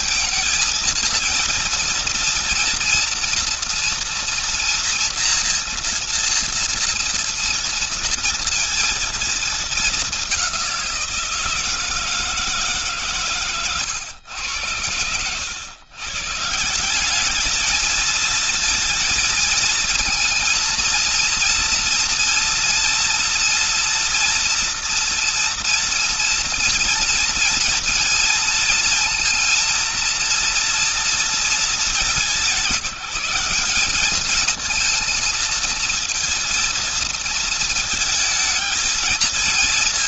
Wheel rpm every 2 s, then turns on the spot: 230, 240, 230, 230, 230, 170, 140, 110, 190, 230, 230, 230, 230, 230, 230, 230, 180, 220, 230, 220.
none